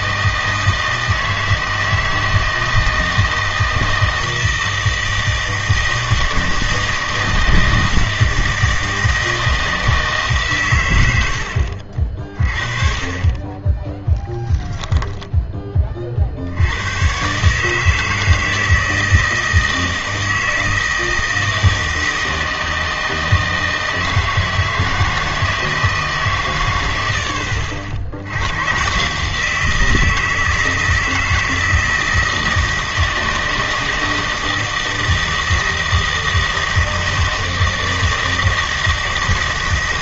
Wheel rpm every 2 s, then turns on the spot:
160, 160, 160, 160, 160, 120, 40, 10, 100, 160, 160, 160, 160, 110, 120, 160, 160, 160, 160, 160.
14-16